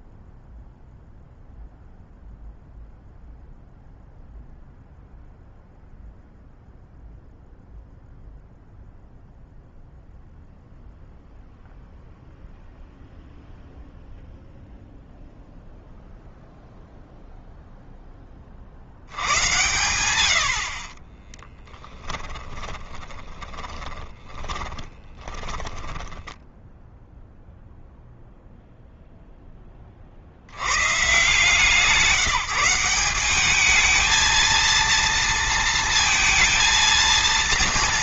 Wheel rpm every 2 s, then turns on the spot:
0, 0, 0, 0, 0, 0, 0, 0, 0, 70, 40, 20, 20, 0, 0, 130, 180, 230, 230.
20-26